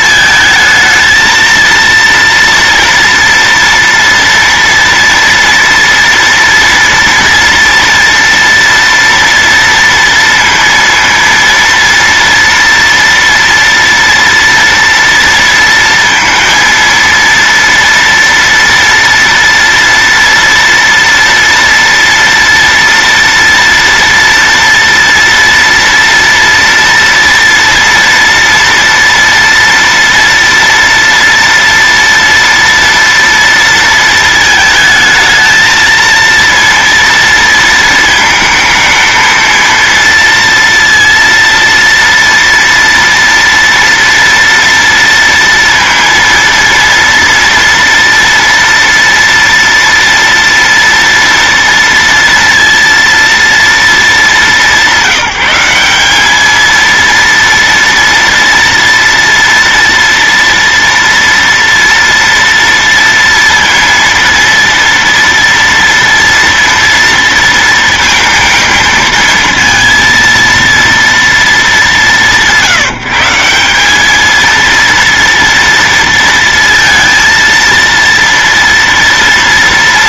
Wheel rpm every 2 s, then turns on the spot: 220, 230, 230, 230, 230, 230, 230, 230, 230, 230, 230, 230, 230, 230, 230, 230, 230, 220, 230, 220, 230, 230, 230, 230, 230, 230, 230, 200, 220, 230, 230, 230, 230, 230, 230, 230, 180, 230, 230, 230.
none